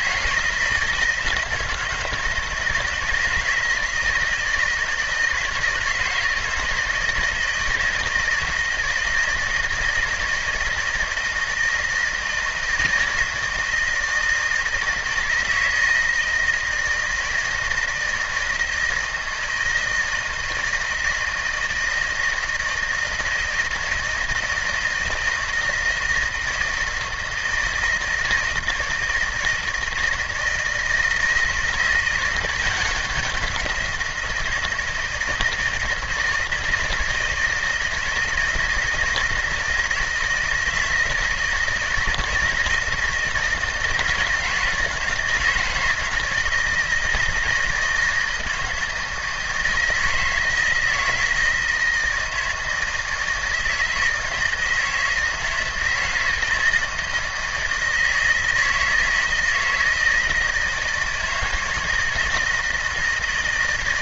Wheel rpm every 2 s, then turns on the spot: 160, 160, 160, 170, 160, 160, 160, 160, 160, 160, 160, 160, 160, 160, 160, 160, 180, 160, 160, 160, 160, 160, 160, 170, 160, 160, 160, 160, 160, 160, 160, 160.
none